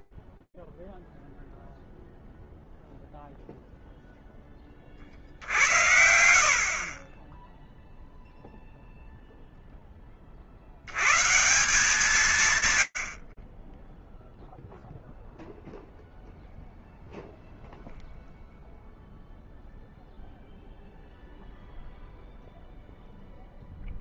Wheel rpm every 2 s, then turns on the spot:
0, 0, 50, 20, 10, 130, 20, 0, 0, 0, 0, 0.
4-8